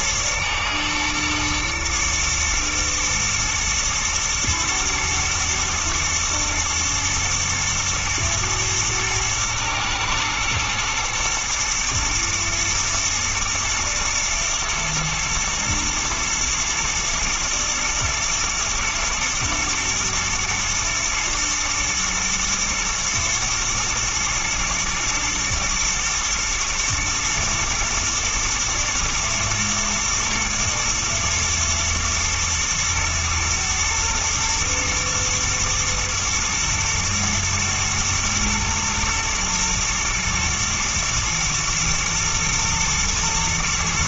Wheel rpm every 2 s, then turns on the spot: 120, 110, 110, 110, 120, 110, 110, 110, 110, 120, 110, 110, 110, 110, 110, 120, 120, 120, 120, 110, 120, 110.
none